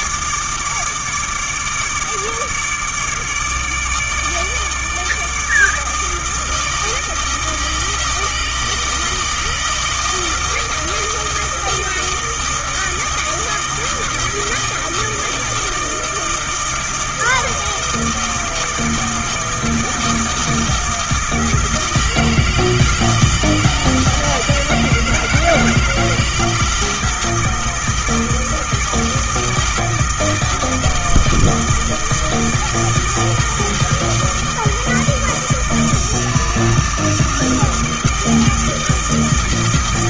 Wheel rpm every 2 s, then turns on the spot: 150, 150, 150, 160, 160, 160, 160, 160, 160, 160, 160, 160, 160, 160, 160, 160, 160, 160, 160, 160.
none